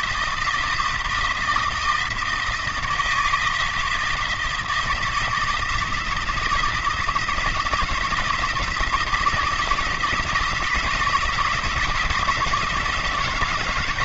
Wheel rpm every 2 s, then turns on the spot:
160, 160, 170, 170, 160, 160, 160.
none